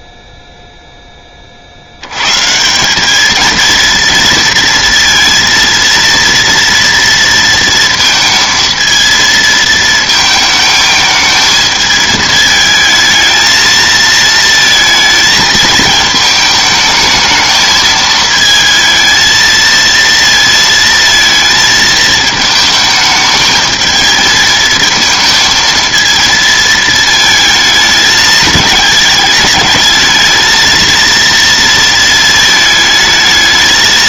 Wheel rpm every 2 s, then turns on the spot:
0, 170, 230, 230, 230, 220, 220, 220, 220, 220, 230, 220, 220, 220, 210, 230, 220.
none